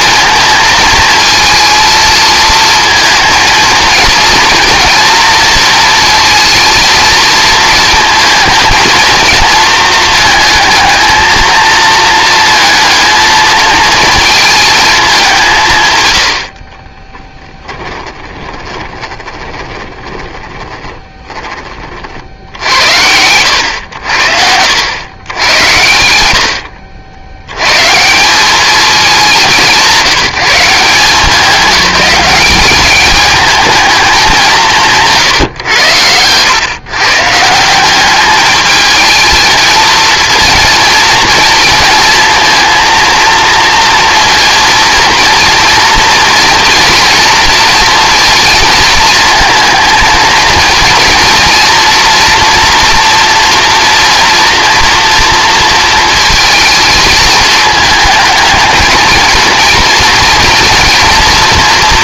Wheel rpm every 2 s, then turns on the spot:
230, 220, 240, 230, 230, 220, 230, 210, 30, 20, 20, 80, 90, 70, 210, 170, 210, 170, 130, 220, 230, 230, 230, 230, 230, 230, 240, 230, 220, 230, 230.
16-22